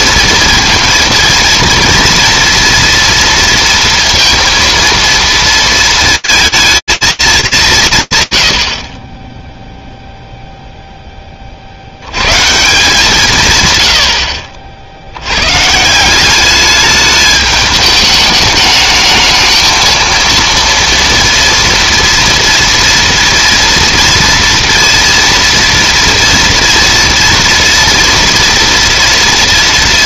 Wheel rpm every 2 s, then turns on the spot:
230, 230, 230, 220, 40, 20, 160, 90, 210, 220, 230, 230, 230, 230, 230.
none